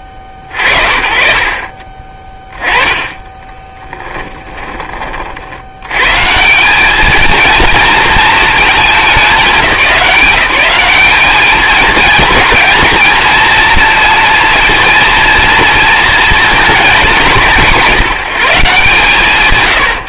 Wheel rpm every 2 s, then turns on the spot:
50, 20, 20, 180, 220, 190, 220, 230, 180, 130.
2-6